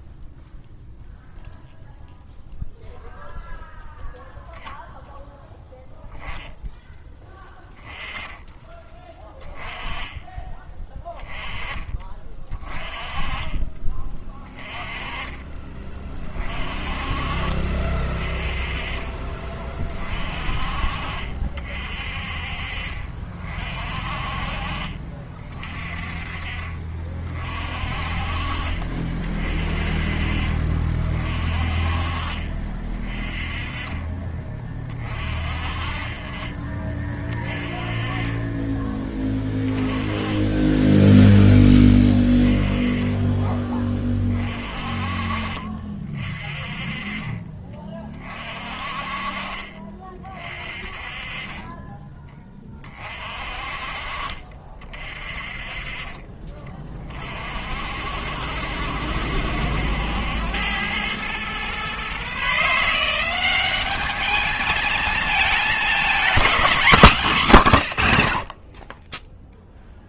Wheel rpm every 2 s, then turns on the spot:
0, 0, 0, 10, 20, 20, 20, 20, 30, 30, 50, 50, 40, 40, 40, 40, 40, 40, 30, 20, 10, 20, 40, 40, 40, 40, 40, 40, 30, 60, 100, 160, 220, 220, 40.
20-22 40-42